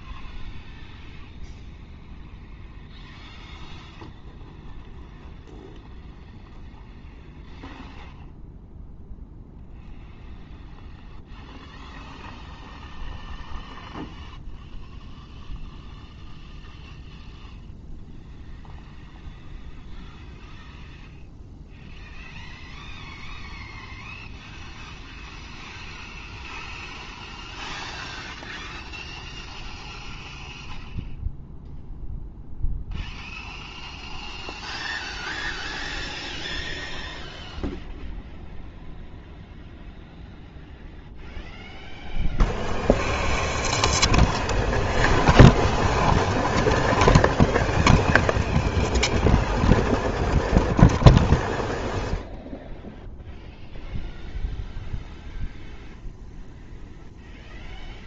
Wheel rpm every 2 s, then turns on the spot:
0, 0, 0, 0, 0, 0, 0, 0, 0, 0, 0, 0, 0, 0, 0, 0, 0, 0, 0, 0, 0, 0, 0, 0, 0, 0, 0, 0, 0.
none